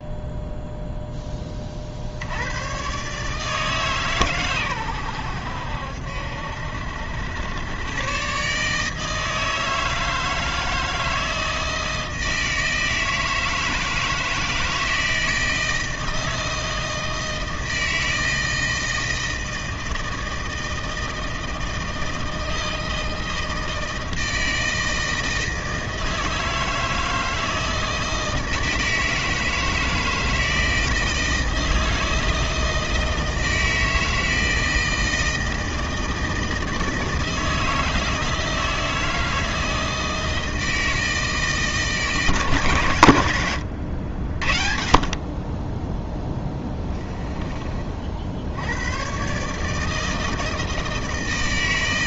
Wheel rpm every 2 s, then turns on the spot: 0, 110, 110, 70, 150, 160, 160, 160, 160, 160, 160, 160, 160, 160, 160, 160, 160, 160, 160, 160, 160, 140, 40, 10, 100, 160.
46-48